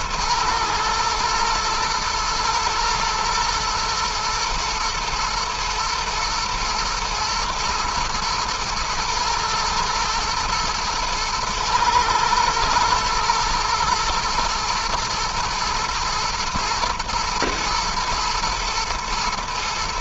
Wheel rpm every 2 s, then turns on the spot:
110, 120, 120, 120, 110, 110, 120, 120, 120, 110.
none